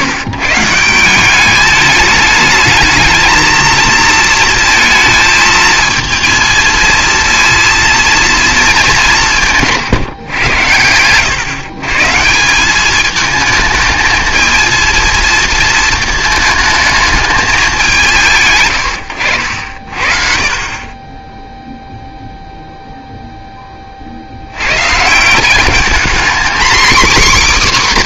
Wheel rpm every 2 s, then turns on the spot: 150, 210, 230, 230, 230, 110, 190, 230, 220, 110, 40, 0, 90, 240.
none